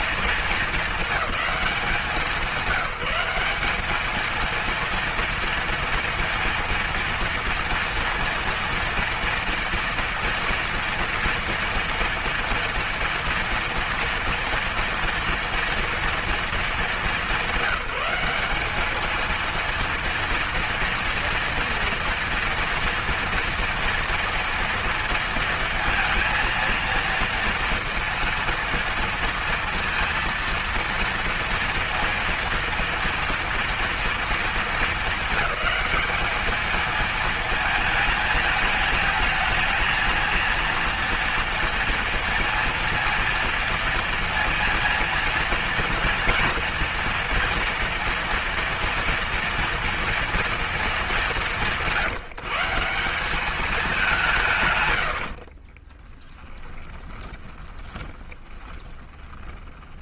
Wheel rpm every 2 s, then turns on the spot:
220, 190, 220, 230, 230, 230, 230, 230, 230, 200, 230, 230, 230, 230, 230, 230, 230, 230, 220, 220, 220, 230, 230, 230, 230, 230, 170, 180, 20, 30.
56-60